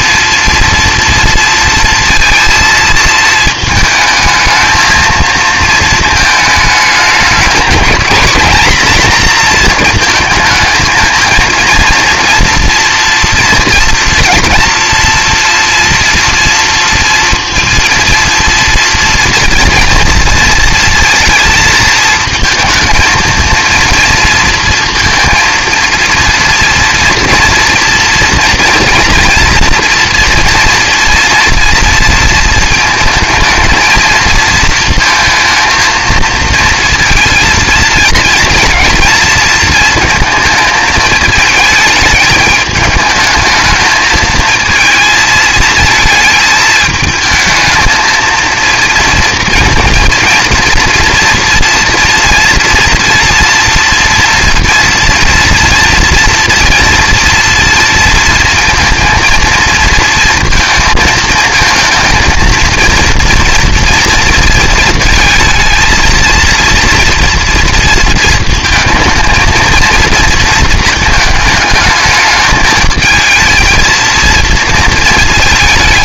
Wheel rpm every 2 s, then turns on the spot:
230, 230, 220, 210, 240, 220, 230, 240, 230, 230, 230, 220, 230, 230, 240, 230, 220, 220, 230, 230, 220, 210, 220, 220, 220, 230, 230, 230, 230, 230, 230, 230, 230, 230, 220, 220, 220, 230.
none